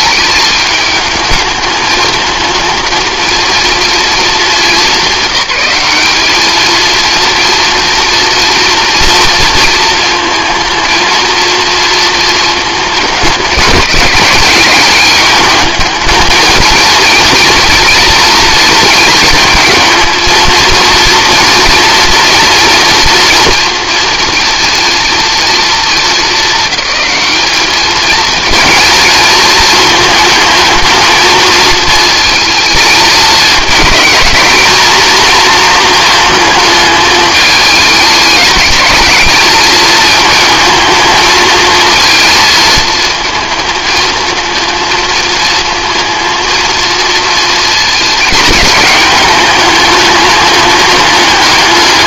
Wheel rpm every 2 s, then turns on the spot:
210, 220, 220, 210, 230, 230, 220, 200, 220, 220, 220, 230, 230, 220, 220, 220, 220, 220, 220, 210, 220, 220, 220, 230, 220, 210.
none